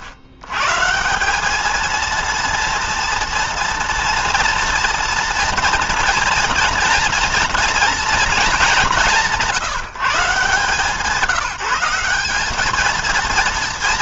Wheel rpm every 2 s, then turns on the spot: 110, 230, 240, 230, 210, 180, 210.
none